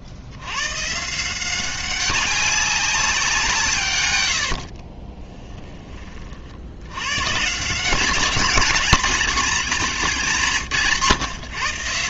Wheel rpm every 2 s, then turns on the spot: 110, 190, 70, 60, 210, 170.
4-6